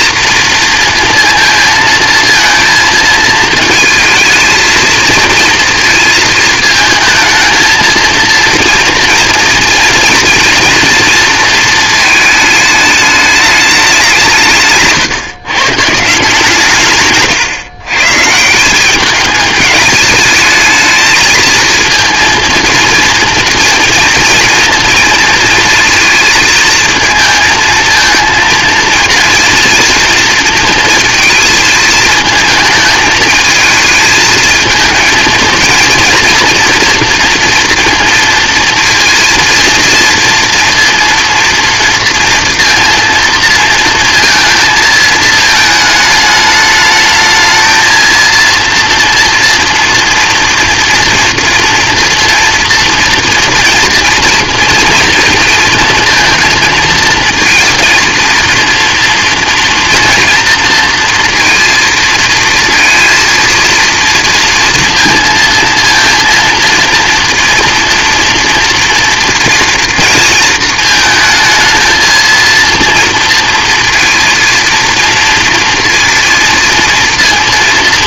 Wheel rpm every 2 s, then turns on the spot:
230, 220, 230, 230, 230, 230, 210, 140, 140, 180, 220, 230, 230, 230, 230, 230, 220, 220, 230, 230, 230, 230, 220, 210, 230, 230, 230, 230, 220, 230, 230, 230, 230, 230, 230, 220, 230, 230, 230.
none